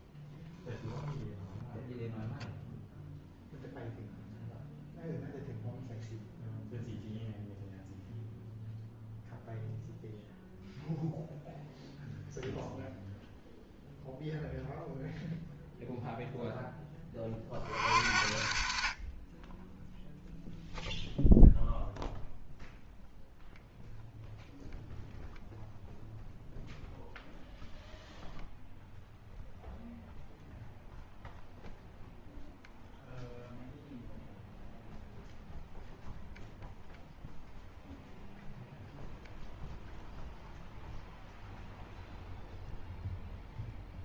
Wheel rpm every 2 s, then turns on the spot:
0, 0, 0, 0, 0, 0, 0, 0, 10, 40, 0, 0, 0, 0, 0, 0, 0, 0, 0, 0, 0, 0.
none